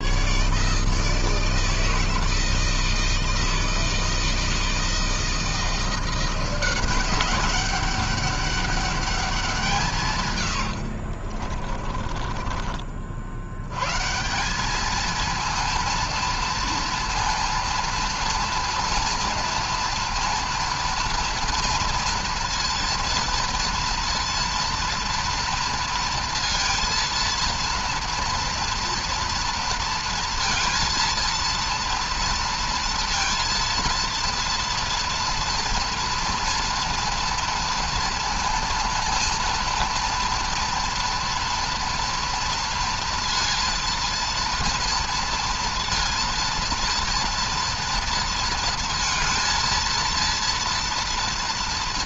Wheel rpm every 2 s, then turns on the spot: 140, 160, 160, 180, 200, 130, 30, 170, 230, 230, 230, 230, 230, 230, 230, 230, 230, 230, 230, 230, 230, 230, 230, 230, 220, 230.
10-14